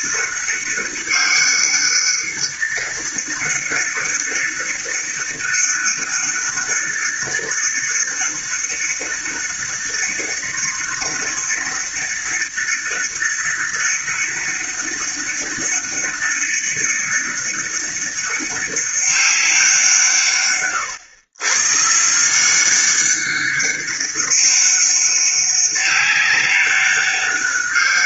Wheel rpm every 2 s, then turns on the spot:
200, 200, 200, 200, 200, 200, 200, 200, 200, 200, 120, 200, 200, 200.
none